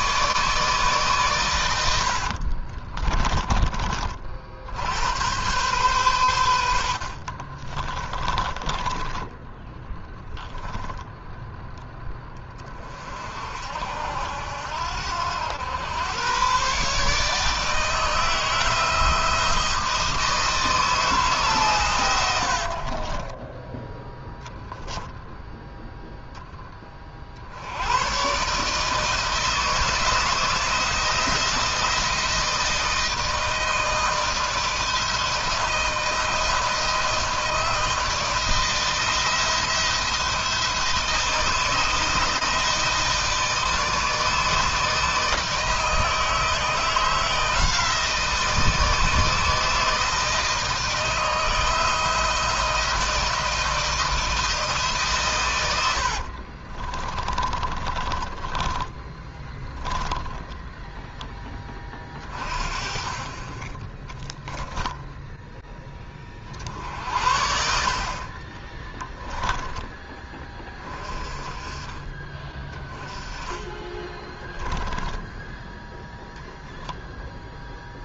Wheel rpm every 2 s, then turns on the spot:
140, 30, 80, 50, 20, 10, 40, 80, 140, 160, 150, 40, 10, 30, 150, 170, 160, 160, 160, 170, 160, 160, 160, 170, 160, 160, 160, 140, 30, 20, 10, 20, 10, 70, 20, 30, 10, 10, 0.
2-4 6-10 22-26 56-60 64-66 68-70 74-76